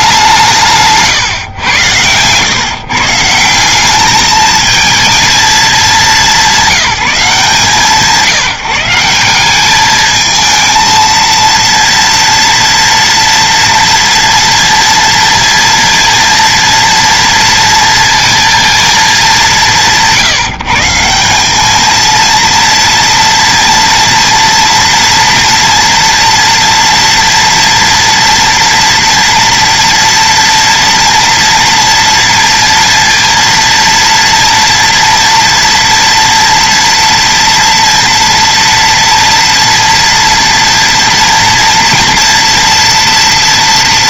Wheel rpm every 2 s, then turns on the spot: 160, 130, 220, 200, 160, 220, 230, 230, 230, 230, 150, 230, 230, 240, 240, 230, 230, 230, 230, 230, 230, 240.
none